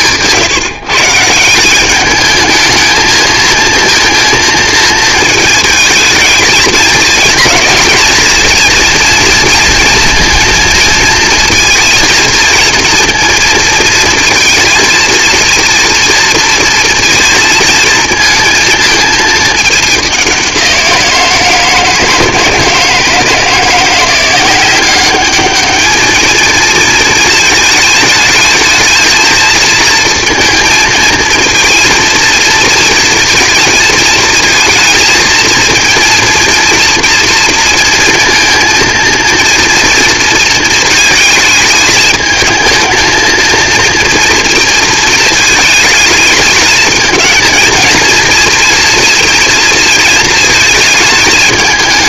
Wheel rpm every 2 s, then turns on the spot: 140, 220, 230, 210, 230, 230, 230, 230, 230, 230, 180, 160, 180, 220, 220, 230, 230, 220, 230, 230, 230, 220, 230, 220, 230, 220.
none